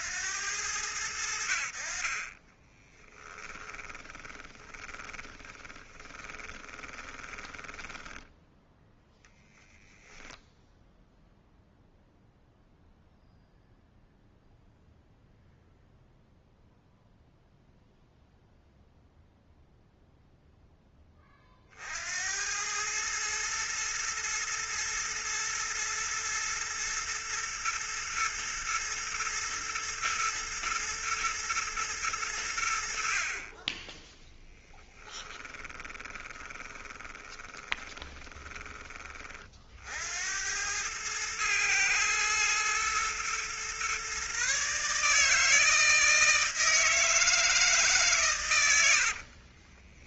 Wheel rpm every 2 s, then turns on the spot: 90, 10, 10, 20, 0, 0, 0, 0, 0, 0, 10, 100, 120, 120, 120, 110, 70, 10, 20, 20, 110, 120, 150, 160, 100.
2-8 34-38